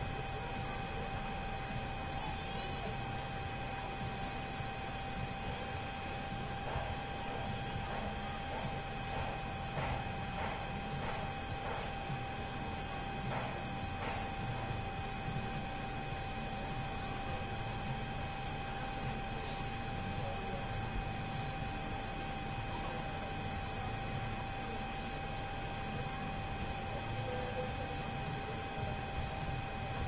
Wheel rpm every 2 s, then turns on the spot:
0, 0, 0, 0, 0, 0, 0, 0, 0, 0, 0, 0, 0, 0, 0.
none